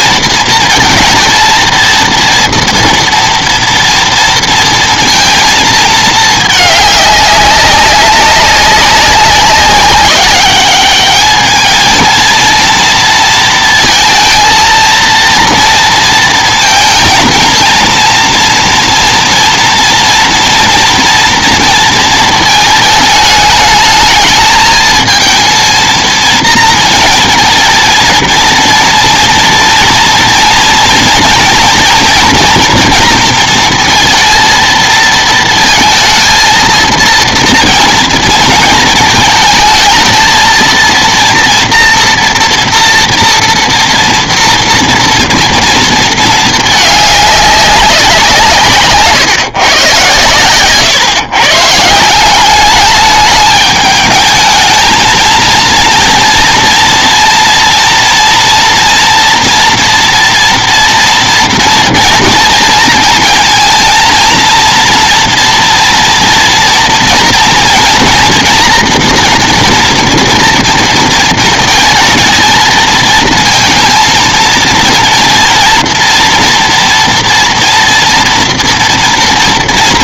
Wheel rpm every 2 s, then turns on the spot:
230, 230, 230, 210, 190, 200, 230, 230, 230, 230, 240, 220, 220, 230, 230, 230, 230, 230, 230, 220, 230, 240, 230, 210, 150, 130, 210, 220, 230, 230, 230, 230, 230, 230, 230, 230, 220, 230, 230, 230.
none